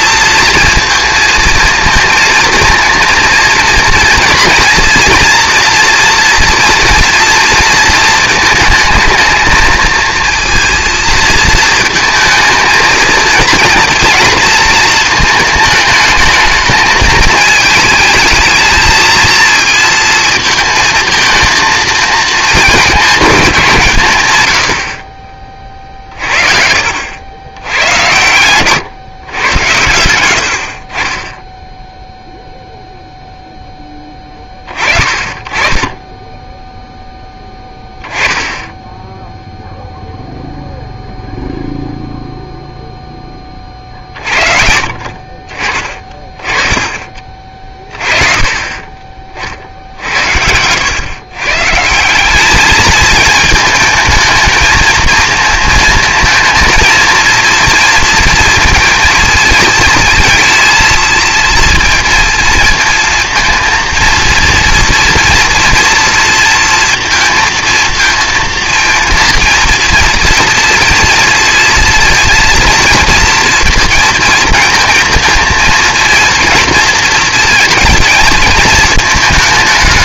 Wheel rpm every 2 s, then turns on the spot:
230, 230, 240, 230, 220, 230, 230, 230, 220, 220, 230, 220, 70, 50, 130, 60, 0, 30, 10, 10, 0, 0, 50, 20, 30, 100, 210, 220, 230, 230, 230, 230, 230, 230, 230, 230, 230, 230, 230, 220.
26-28 44-46